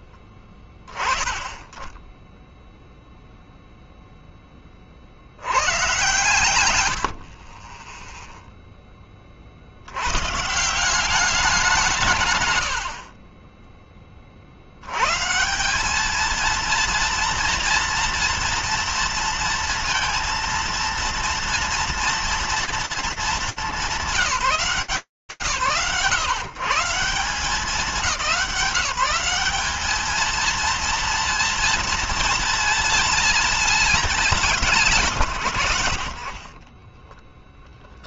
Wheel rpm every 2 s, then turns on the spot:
10, 0, 100, 40, 30, 190, 70, 100, 230, 230, 230, 200, 140, 180, 210, 230, 220, 100, 10.
36-38